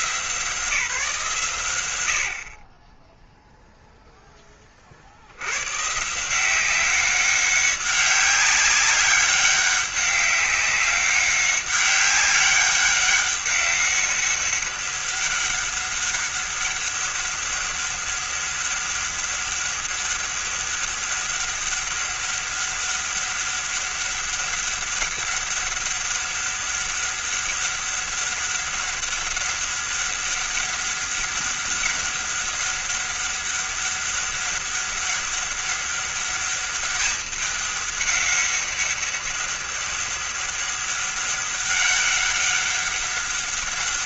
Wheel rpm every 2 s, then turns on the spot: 160, 30, 50, 190, 200, 200, 200, 200, 200, 200, 200, 200, 200, 200, 200, 200, 200, 200, 200, 200, 200, 200.
none